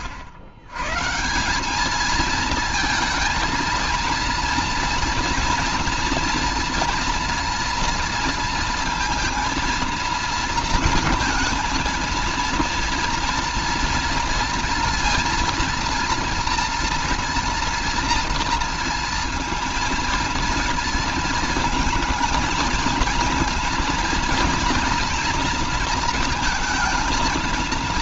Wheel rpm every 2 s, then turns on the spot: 100, 220, 230, 230, 230, 230, 230, 230, 230, 230, 230, 220, 230, 220.
none